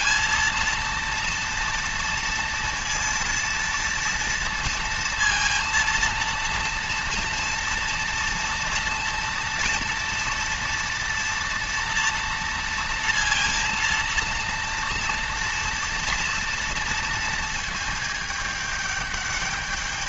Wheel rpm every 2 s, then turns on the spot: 230, 230, 230, 230, 230, 230, 230, 230, 230, 210.
none